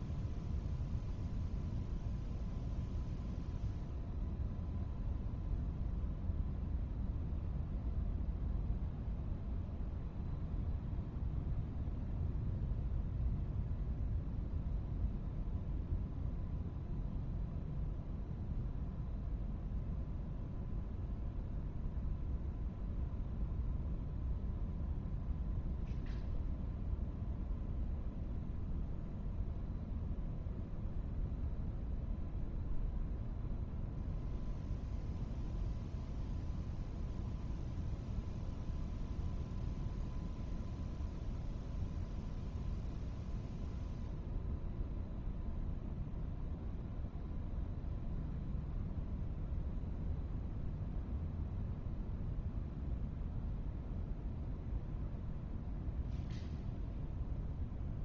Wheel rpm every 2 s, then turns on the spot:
0, 0, 0, 0, 0, 0, 0, 0, 0, 0, 0, 0, 0, 0, 0, 0, 0, 0, 0, 0, 0, 0, 0, 0, 0, 0, 0, 0, 0.
none